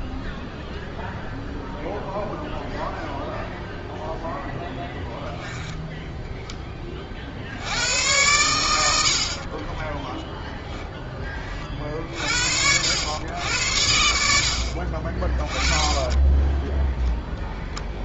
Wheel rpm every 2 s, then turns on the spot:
0, 0, 0, 20, 100, 10, 70, 70, 10.
16-18